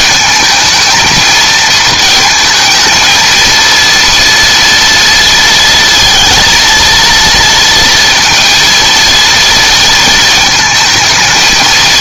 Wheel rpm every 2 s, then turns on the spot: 220, 230, 230, 230, 230, 220.
none